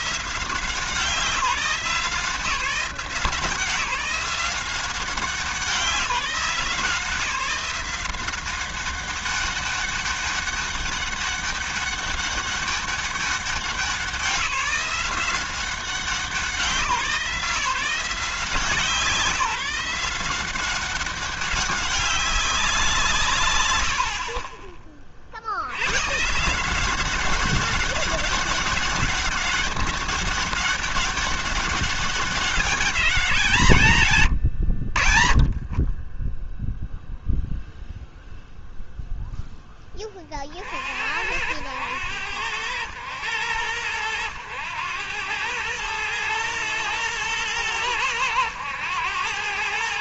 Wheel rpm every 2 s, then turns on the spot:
170, 170, 190, 170, 190, 200, 200, 170, 170, 160, 190, 180, 40, 170, 200, 200, 200, 80, 10, 0, 60, 100, 100, 120, 100.
none